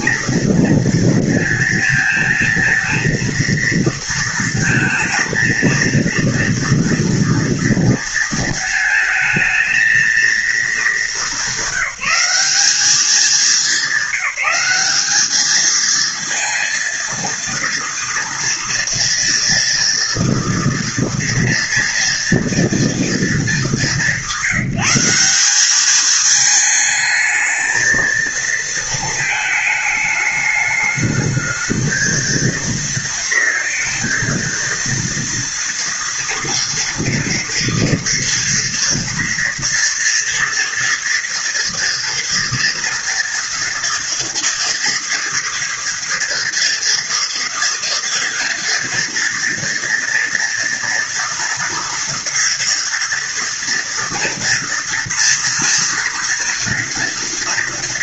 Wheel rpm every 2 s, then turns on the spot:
230, 230, 230, 230, 220, 210, 200, 200, 230, 230, 230, 230, 180, 220, 220, 210, 230, 230, 230, 230, 240, 230, 240, 230, 230, 230, 230, 230, 230.
none